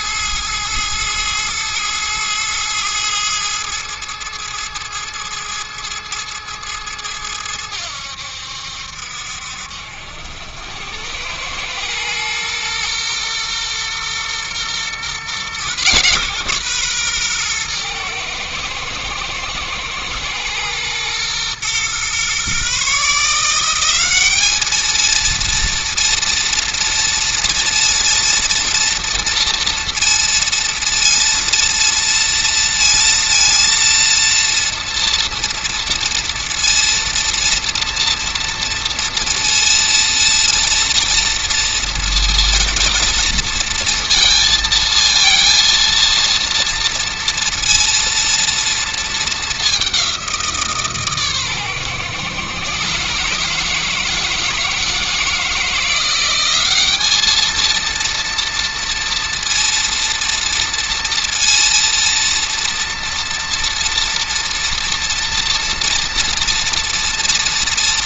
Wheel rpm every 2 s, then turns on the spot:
110, 110, 110, 110, 70, 90, 120, 130, 130, 110, 120, 150, 220, 230, 230, 230, 230, 230, 230, 230, 230, 230, 230, 230, 230, 150, 140, 160, 200, 230, 230, 240, 230, 240.
none